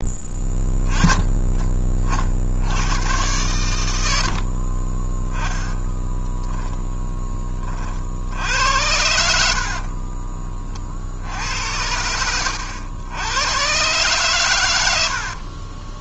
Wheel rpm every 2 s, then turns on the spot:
10, 90, 40, 10, 80, 50, 90, 100.
4-6